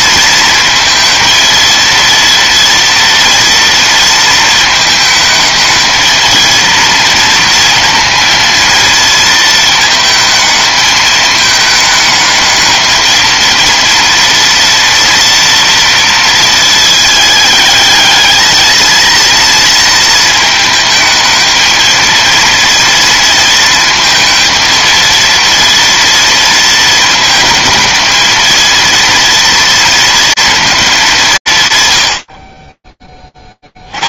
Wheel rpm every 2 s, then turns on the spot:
230, 230, 220, 230, 220, 210, 230, 230, 220, 230, 220, 230, 240, 220, 230, 160, 0.
none